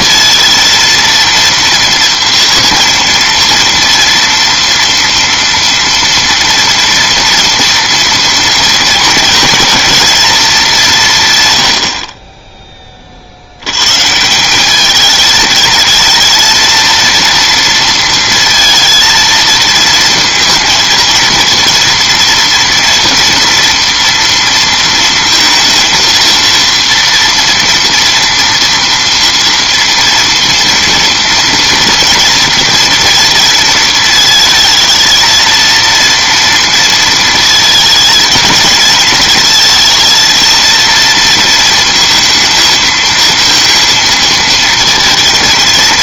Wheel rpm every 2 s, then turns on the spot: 230, 230, 230, 230, 230, 190, 20, 200, 230, 230, 230, 230, 230, 230, 230, 230, 230, 220, 230, 220, 230, 230, 230.
none